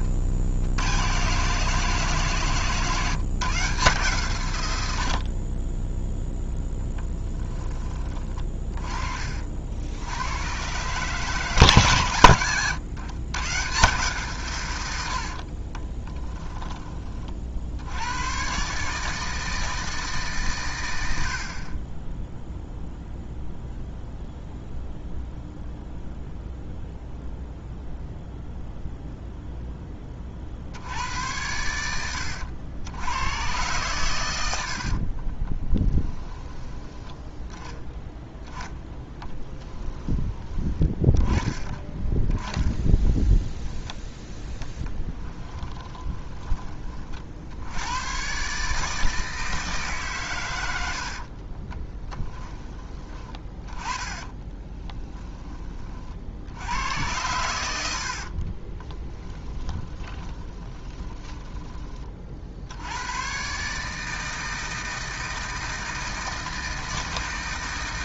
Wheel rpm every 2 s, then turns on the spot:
90, 150, 100, 10, 30, 130, 120, 100, 20, 140, 100, 0, 0, 0, 0, 80, 90, 60, 10, 10, 30, 20, 20, 30, 150, 80, 20, 10, 100, 20, 20, 90, 160, 160.
34-36 42-46 54-56 58-62